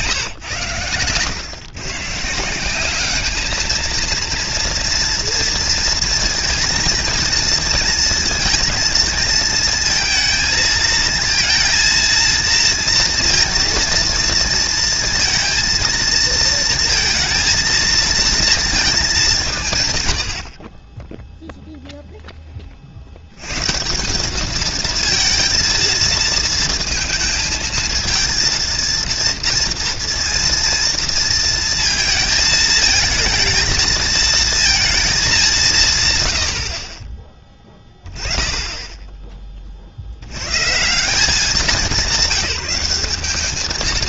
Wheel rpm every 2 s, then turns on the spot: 110, 200, 230, 230, 230, 230, 230, 230, 230, 200, 10, 40, 220, 230, 230, 230, 220, 220, 50, 10, 100, 200.
none